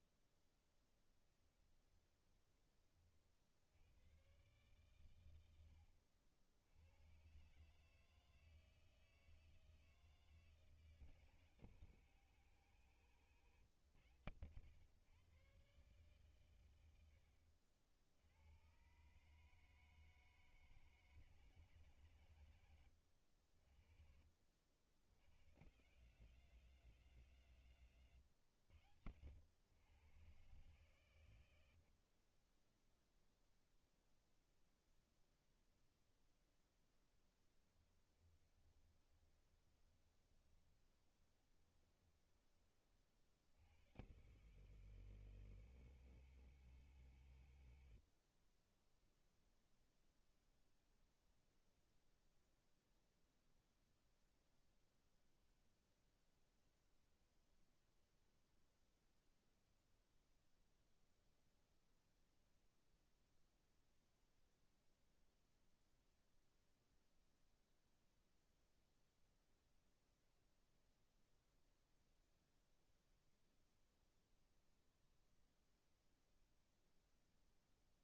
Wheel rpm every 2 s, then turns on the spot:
0, 30, 120, 90, 160, 160, 150, 110, 100, 110, 150, 90, 70, 180, 110, 120, 10, 0, 0, 20, 20, 30, 140, 150, 20, 0, 0, 0, 0, 0, 0, 0, 0, 0, 0, 0, 0, 0, 0.
38-42